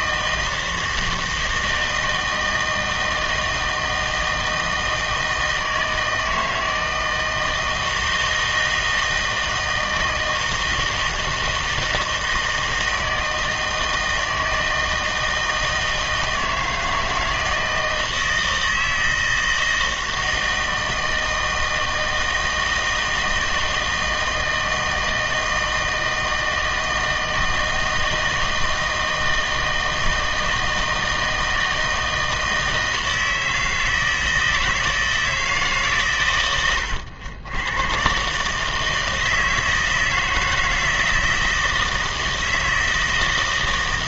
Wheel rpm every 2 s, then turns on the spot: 160, 160, 160, 160, 160, 160, 160, 160, 160, 160, 160, 160, 160, 160, 160, 160, 160, 160, 100, 150, 160, 160.
none